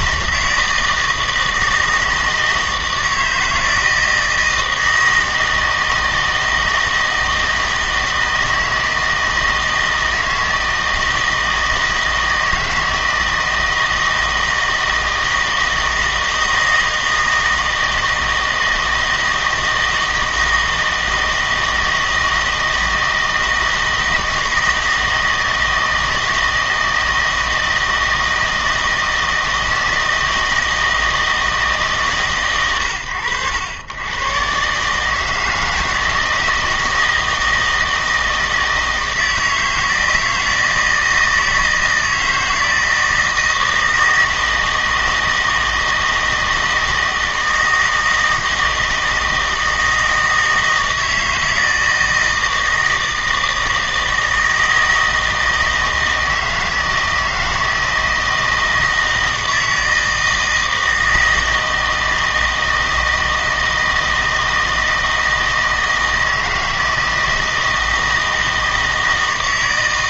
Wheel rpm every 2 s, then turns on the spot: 160, 160, 160, 160, 160, 160, 160, 160, 160, 160, 160, 160, 160, 160, 160, 160, 110, 140, 160, 160, 160, 160, 160, 160, 160, 160, 160, 160, 160, 160, 160, 160, 160, 160, 160.
none